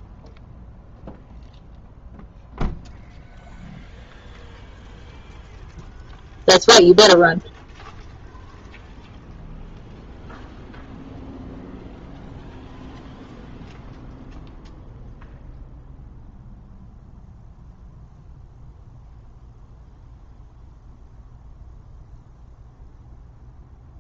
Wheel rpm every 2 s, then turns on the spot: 0, 0, 0, 0, 0, 0, 0, 0, 0, 0, 0, 0.
none